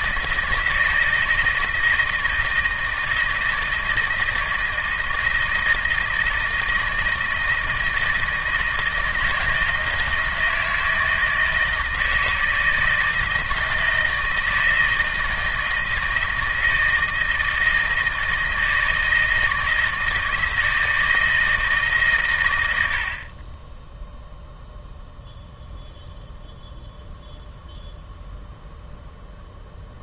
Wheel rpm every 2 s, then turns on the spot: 160, 160, 160, 160, 160, 160, 160, 160, 160, 160, 160, 100, 0, 0, 0.
none